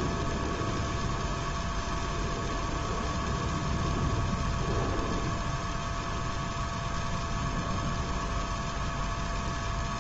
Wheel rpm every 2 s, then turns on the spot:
0, 0, 0, 0, 0.
none